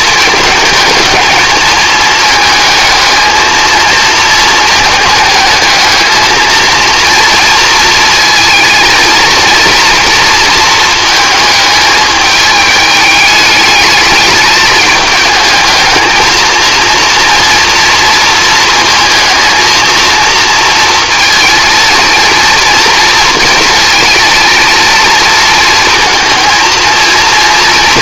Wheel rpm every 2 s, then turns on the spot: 210, 220, 220, 230, 220, 230, 210, 210, 230, 220, 230, 230, 230, 230.
none